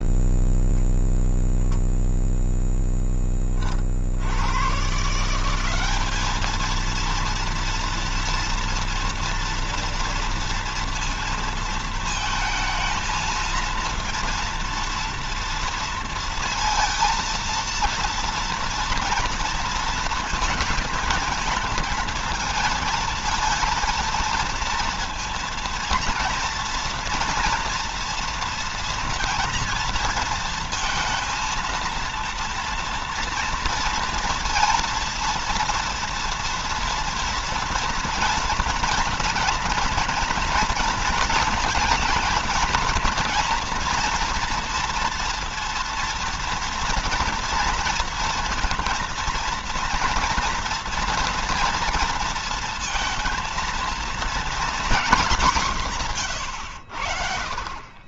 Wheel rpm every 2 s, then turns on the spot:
0, 0, 120, 220, 230, 230, 230, 230, 230, 230, 230, 220, 230, 230, 240, 230, 240, 230, 230, 230, 230, 230, 230, 230, 230, 230, 230, 220, 80.
none